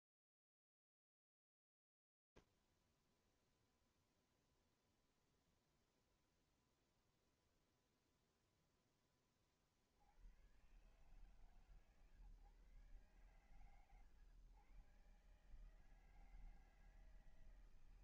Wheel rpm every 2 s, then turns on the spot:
0, 0, 0, 0, 0, 120, 130, 130, 160.
none